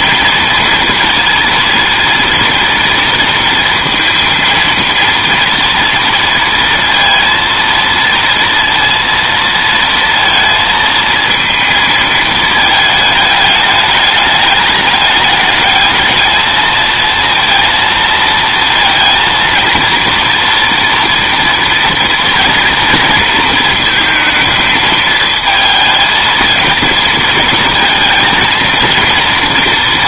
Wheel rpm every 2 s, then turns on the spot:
230, 230, 230, 230, 230, 230, 220, 210, 220, 230, 240, 230, 220, 230, 230.
none